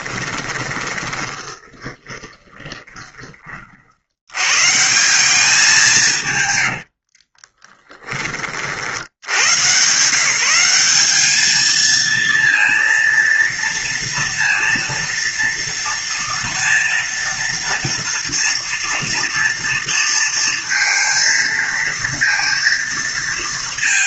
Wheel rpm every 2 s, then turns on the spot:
20, 20, 160, 70, 60, 200, 230, 230, 230, 230, 230, 230.
0-4 6-8